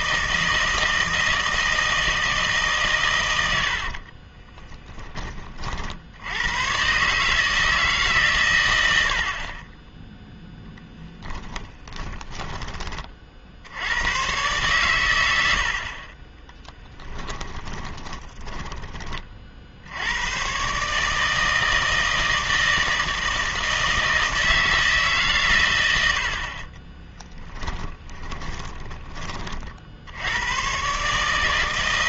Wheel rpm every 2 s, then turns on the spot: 160, 150, 20, 110, 100, 0, 20, 120, 20, 20, 130, 160, 160, 30, 10, 110.
4-6 16-20 28-30